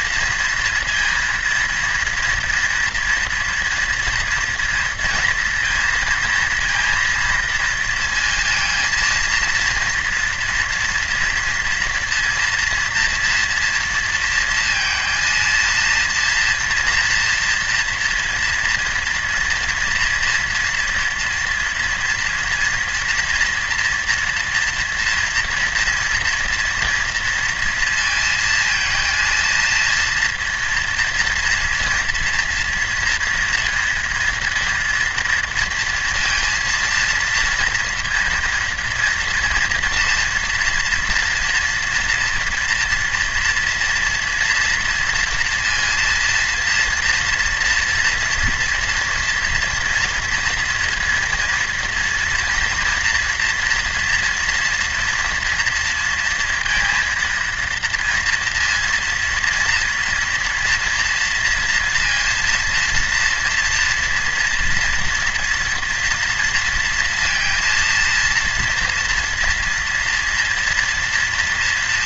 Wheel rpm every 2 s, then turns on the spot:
230, 240, 230, 230, 230, 230, 230, 230, 230, 240, 240, 230, 230, 230, 230, 240, 230, 230, 230, 230, 240, 240, 230, 230, 230, 230, 230, 230, 230, 230, 240, 230, 230, 240, 230, 230.
none